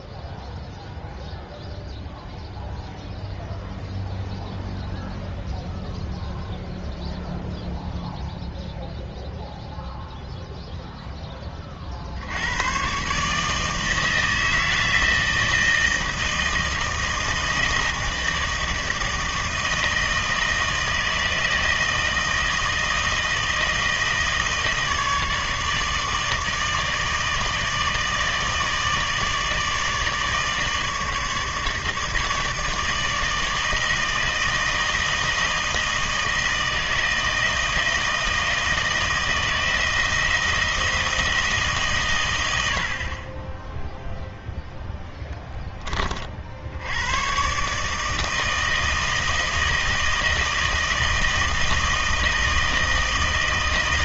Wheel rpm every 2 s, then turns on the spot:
0, 0, 0, 0, 0, 0, 120, 160, 160, 160, 160, 160, 160, 160, 160, 160, 160, 160, 160, 160, 160, 60, 10, 80, 160, 160, 160.
44-46